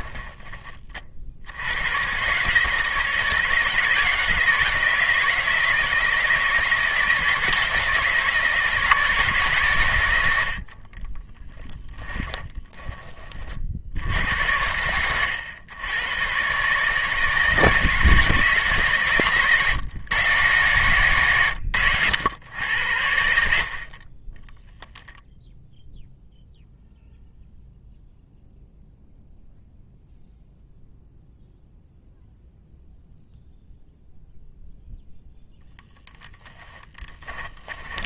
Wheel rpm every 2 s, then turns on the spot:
30, 160, 160, 160, 160, 50, 10, 100, 150, 140, 140, 90, 0, 0, 0, 0, 0, 0, 10.
10-12 36-38